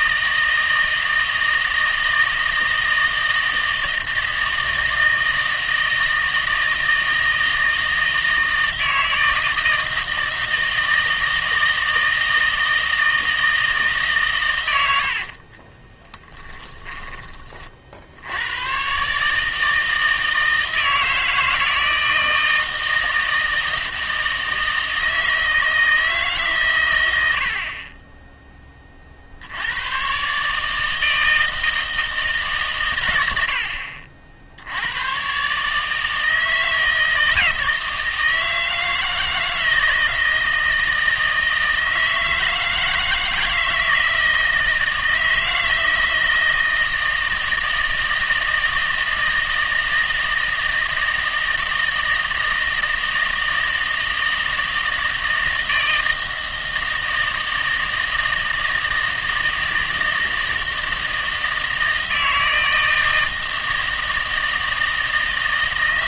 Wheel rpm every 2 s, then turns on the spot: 160, 160, 160, 160, 160, 160, 160, 100, 10, 110, 160, 160, 160, 130, 20, 150, 130, 70, 160, 160, 160, 160, 160, 160, 160, 160, 160, 160, 160, 160, 160, 160, 160.
none